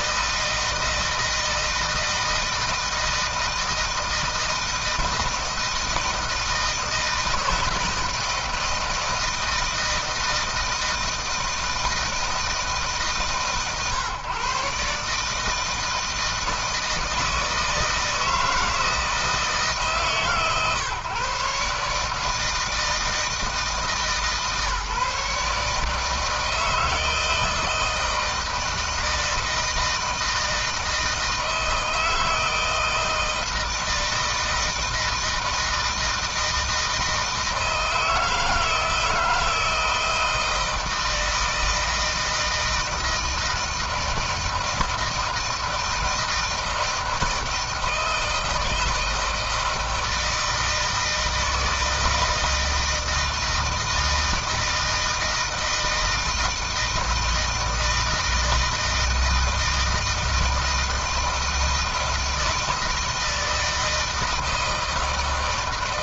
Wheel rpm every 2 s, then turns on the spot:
160, 160, 160, 160, 160, 160, 160, 140, 160, 160, 140, 160, 150, 160, 160, 160, 160, 160, 160, 160, 160, 160, 160, 160, 160, 160, 160, 160, 160, 160, 160, 160, 160.
none